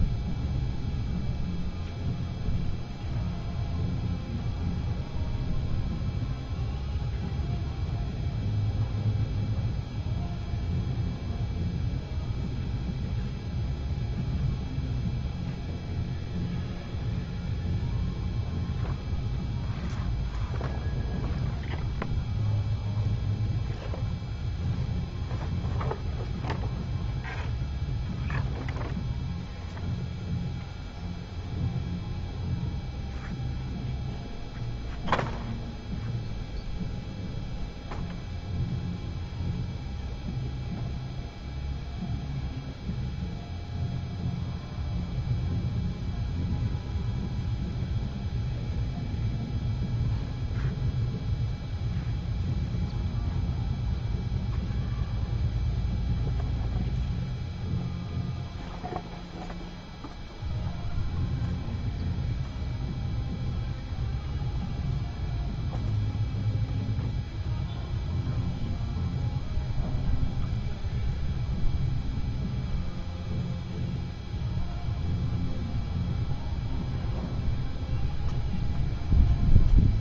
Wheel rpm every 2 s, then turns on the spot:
0, 0, 0, 0, 0, 0, 0, 0, 0, 0, 0, 0, 0, 0, 0, 0, 0, 0, 0, 0, 0, 0, 0, 0, 0, 0, 0, 0, 0, 0, 0, 0, 0, 0, 0, 0, 0, 0, 0, 0.
none